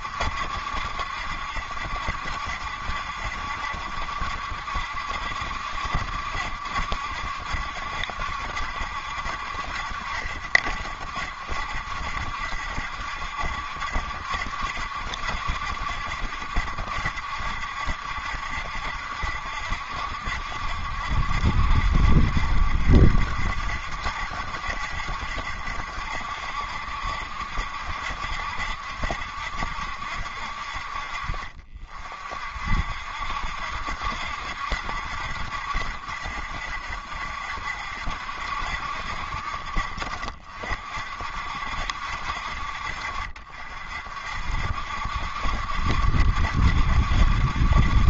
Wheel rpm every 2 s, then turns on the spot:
70, 70, 70, 70, 70, 60, 70, 70, 70, 70, 70, 60, 70, 70, 60, 50, 50, 70, 60, 60, 50, 60, 60, 70.
none